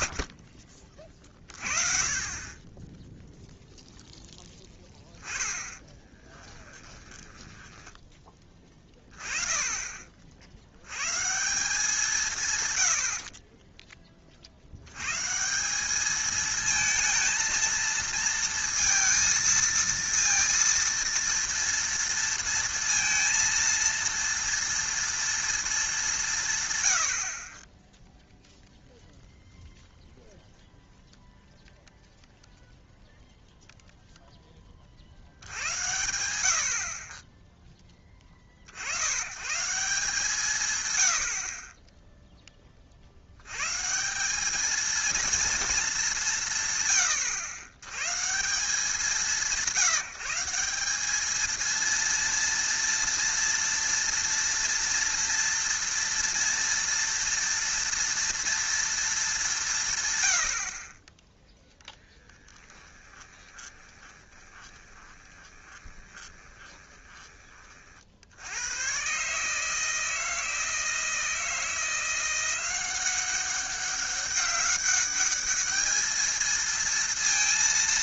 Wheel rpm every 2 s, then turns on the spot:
40, 20, 10, 10, 20, 80, 130, 60, 220, 230, 230, 230, 230, 130, 0, 0, 0, 20, 70, 50, 130, 10, 200, 150, 170, 190, 230, 240, 230, 230, 60, 10, 20, 20, 100, 160, 180, 200, 220.
6-8 62-68